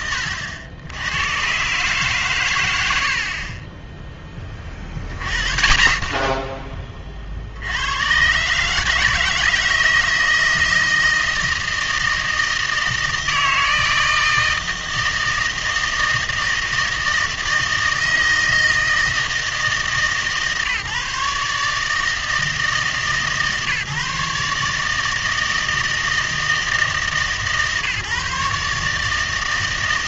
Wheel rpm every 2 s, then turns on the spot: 90, 120, 20, 20, 140, 160, 160, 160, 160, 160, 140, 150, 150, 160, 150.
none